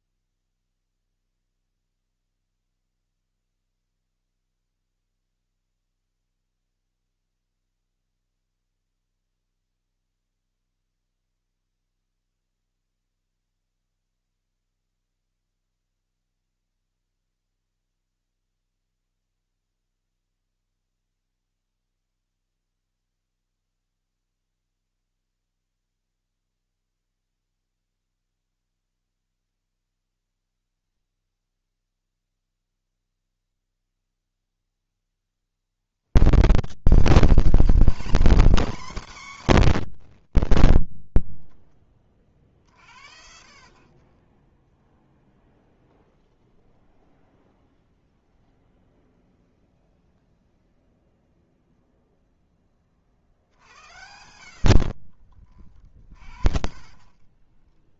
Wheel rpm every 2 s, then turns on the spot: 0, 0, 0, 0, 0, 0, 0, 0, 0, 0, 0, 0, 0, 0, 0, 60, 20, 90, 140, 150, 70, 50, 20, 0, 0, 0, 10, 70, 60.
30-42 44-46 54-58